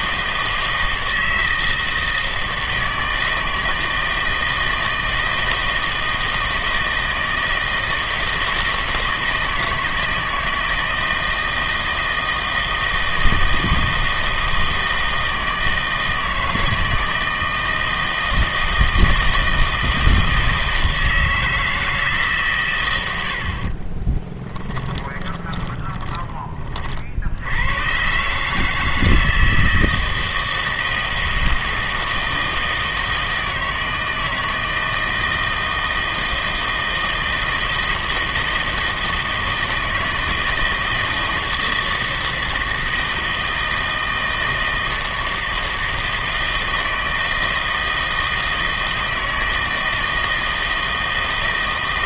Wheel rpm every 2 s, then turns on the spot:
160, 160, 160, 160, 160, 160, 160, 160, 160, 160, 160, 120, 20, 30, 150, 160, 160, 160, 160, 160, 160, 160, 160, 160, 160, 160.
24-26